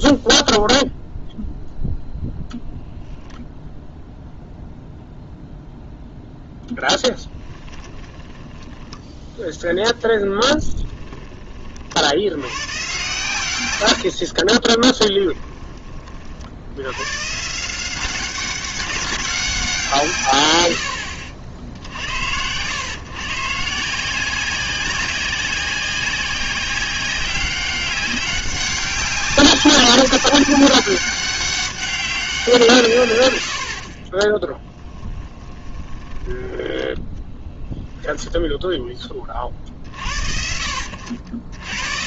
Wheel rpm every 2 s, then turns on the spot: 0, 0, 0, 0, 10, 10, 110, 30, 80, 190, 90, 110, 190, 190, 190, 190, 160, 10, 10, 10, 70.
8-12 14-16 34-36